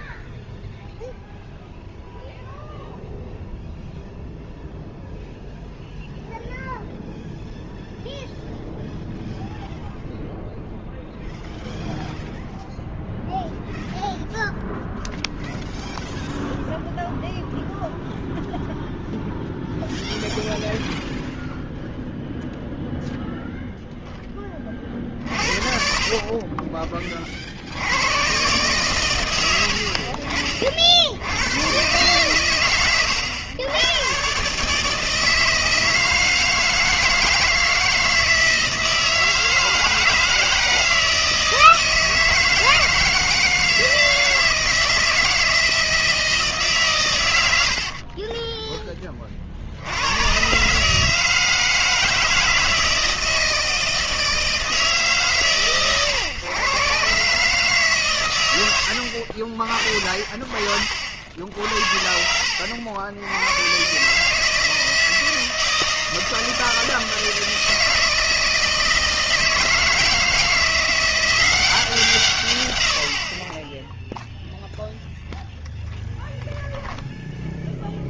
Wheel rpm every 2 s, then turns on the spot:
0, 0, 0, 0, 0, 0, 0, 0, 0, 0, 0, 0, 30, 30, 130, 50, 120, 140, 160, 160, 160, 160, 160, 150, 10, 130, 160, 160, 120, 90, 40, 70, 160, 160, 160, 170, 120, 0, 0.
none